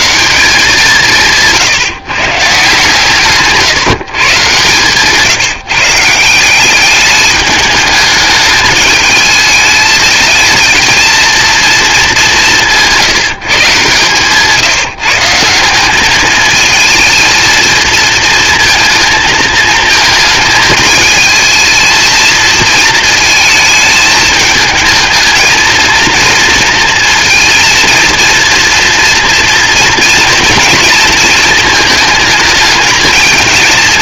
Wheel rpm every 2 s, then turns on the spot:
180, 140, 140, 200, 210, 220, 170, 170, 220, 230, 220, 230, 220, 230, 230, 230, 220.
none